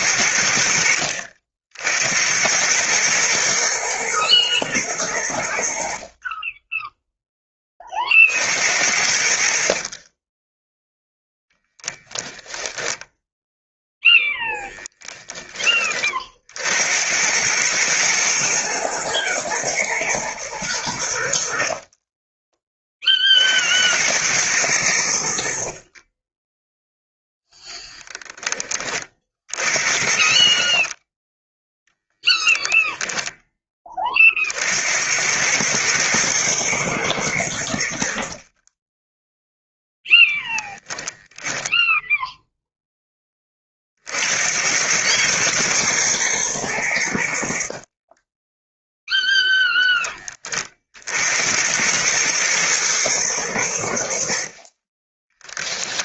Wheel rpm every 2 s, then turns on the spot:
60, 100, 110, 20, 60, 10, 0, 20, 70, 110, 100, 30, 100, 0, 20, 30, 10, 60, 110, 20, 0, 0, 90, 90, 0, 40, 110, 30.
32-34